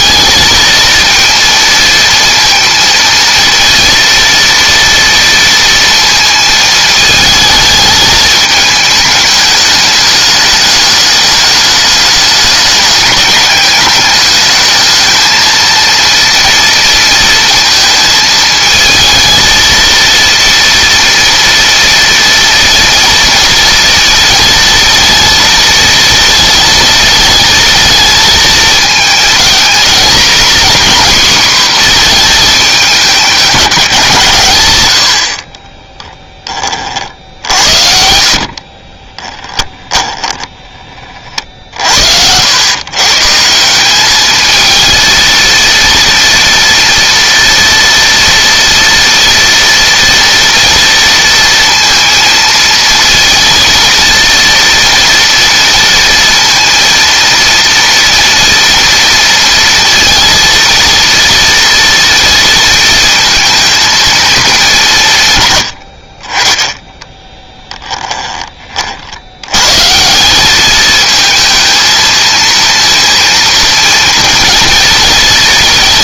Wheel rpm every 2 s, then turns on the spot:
230, 230, 230, 220, 210, 210, 200, 220, 230, 220, 230, 230, 230, 220, 220, 260, 210, 110, 40, 30, 30, 120, 220, 230, 230, 230, 230, 230, 230, 230, 230, 220, 180, 10, 50, 220, 230, 230.
38-40